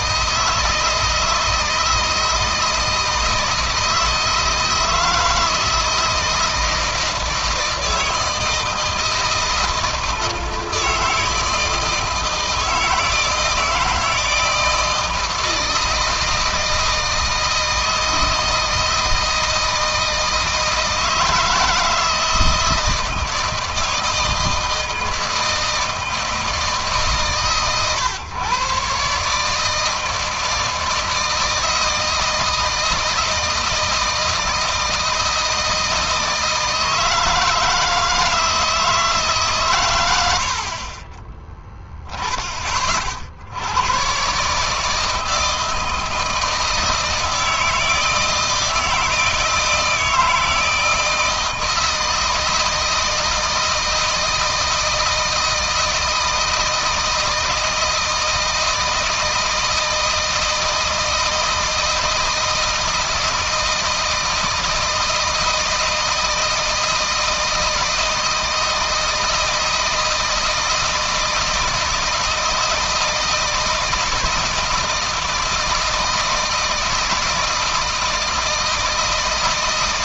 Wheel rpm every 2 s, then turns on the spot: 160, 160, 160, 170, 160, 160, 160, 160, 160, 160, 160, 160, 160, 150, 130, 160, 160, 160, 160, 160, 50, 40, 150, 160, 160, 160, 160, 160, 160, 160, 160, 160, 160, 160, 160, 160, 160, 160, 160, 160.
none